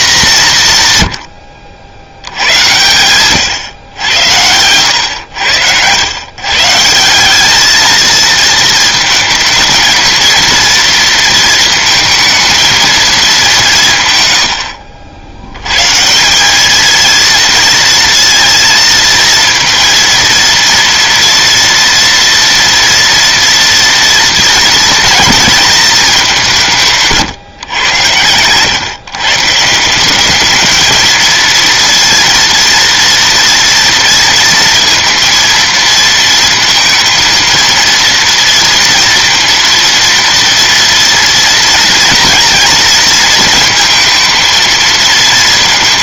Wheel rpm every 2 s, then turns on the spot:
150, 110, 100, 150, 220, 230, 230, 80, 210, 230, 230, 230, 230, 160, 130, 220, 230, 230, 230, 230, 230, 230, 230.
none